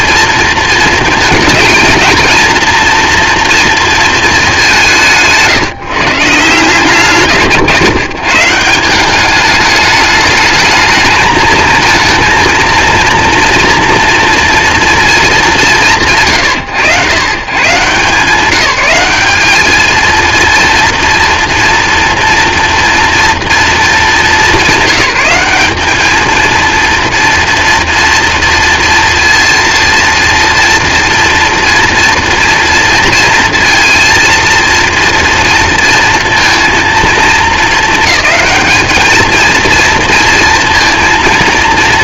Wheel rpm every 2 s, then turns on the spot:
220, 230, 170, 150, 190, 220, 230, 230, 80, 190, 230, 230, 190, 230, 230, 230, 230, 230, 230, 220, 230.
none